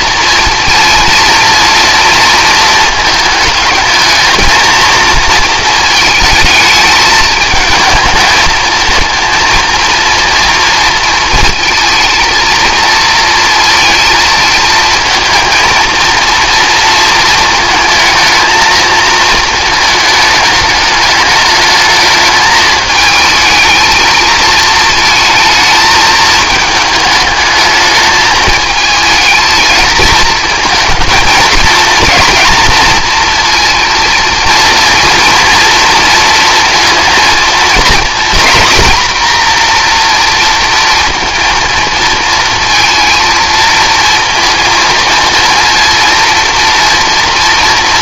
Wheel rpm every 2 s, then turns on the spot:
230, 230, 230, 220, 220, 240, 230, 220, 230, 230, 220, 220, 230, 220, 220, 230, 230, 220, 230, 240, 230, 230, 230, 230.
none